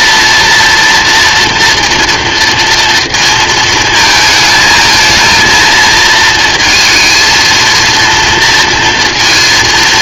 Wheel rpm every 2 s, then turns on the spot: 230, 230, 220, 220, 230.
none